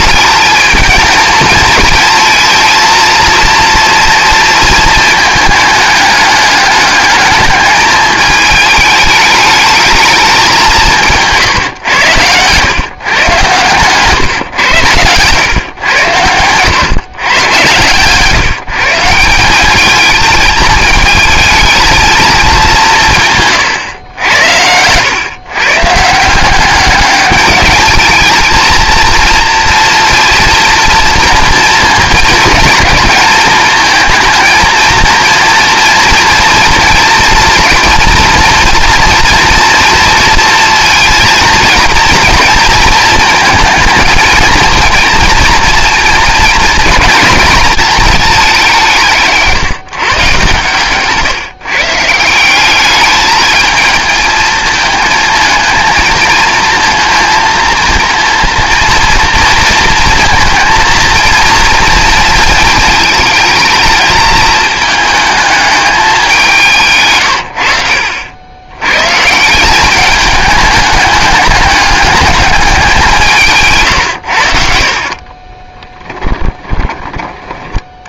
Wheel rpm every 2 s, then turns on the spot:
220, 230, 220, 210, 210, 180, 120, 110, 120, 150, 220, 190, 90, 190, 230, 240, 230, 230, 230, 230, 230, 220, 230, 230, 180, 130, 210, 220, 230, 230, 230, 220, 220, 150, 110, 210, 190, 50, 10.
74-76